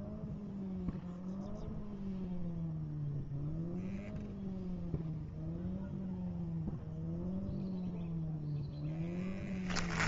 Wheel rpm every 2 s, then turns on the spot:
0, 0, 0, 0, 10.
8-10